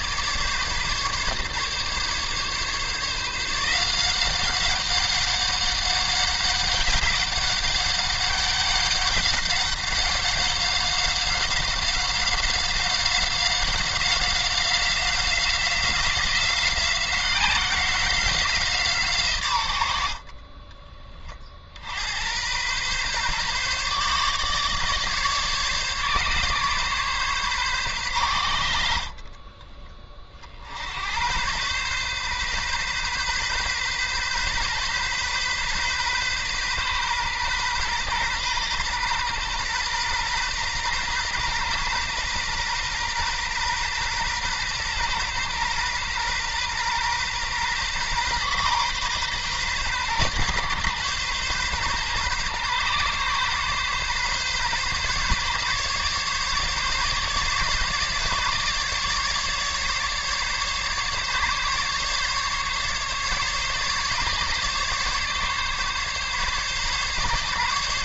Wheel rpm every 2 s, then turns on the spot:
150, 150, 200, 190, 190, 190, 190, 180, 180, 150, 30, 130, 150, 140, 60, 80, 130, 130, 130, 120, 120, 120, 130, 120, 130, 130, 130, 140, 140, 150, 140, 140, 140, 140.
none